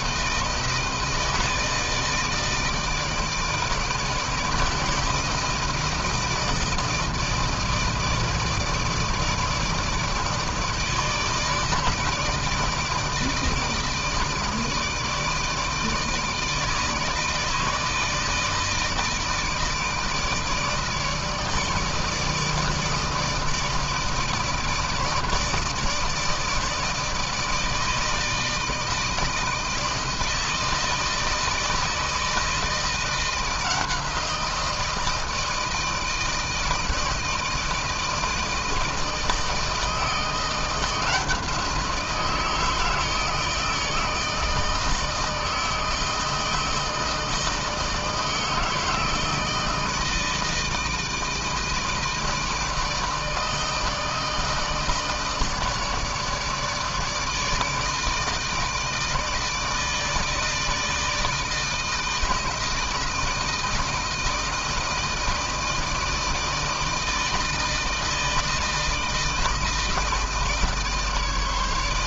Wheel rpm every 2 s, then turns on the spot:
160, 160, 160, 160, 160, 150, 160, 160, 160, 160, 150, 160, 160, 160, 160, 160, 160, 160, 160, 160, 170, 160, 160, 160, 160, 160, 160, 160, 150, 160, 160, 160, 160, 160, 160, 150.
none